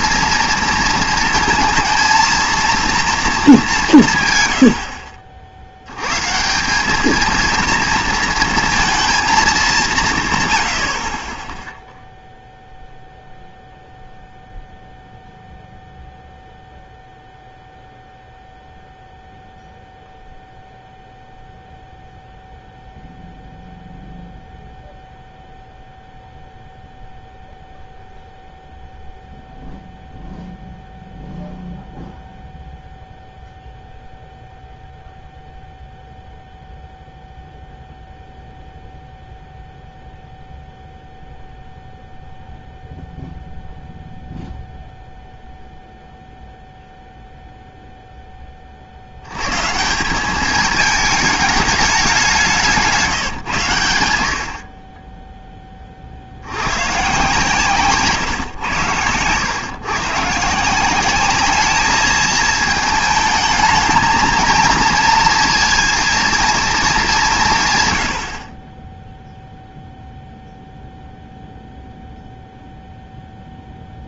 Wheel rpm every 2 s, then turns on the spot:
230, 230, 100, 180, 230, 100, 0, 0, 0, 0, 0, 0, 0, 0, 0, 0, 0, 0, 0, 0, 0, 0, 0, 0, 30, 210, 180, 60, 100, 120, 150, 220, 230, 230, 40, 0, 0.
none